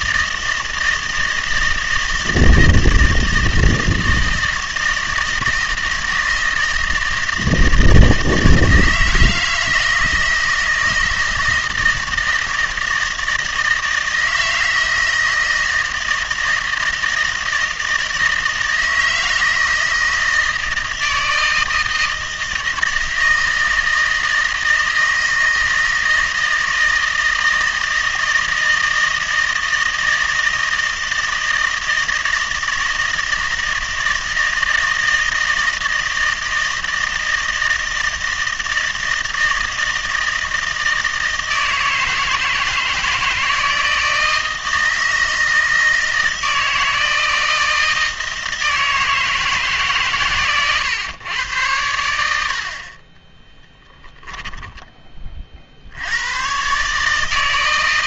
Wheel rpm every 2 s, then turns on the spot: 160, 160, 160, 160, 160, 160, 160, 160, 170, 160, 160, 160, 160, 160, 160, 160, 160, 160, 160, 160, 160, 170, 160, 160, 160, 120, 60, 10, 130.
54-56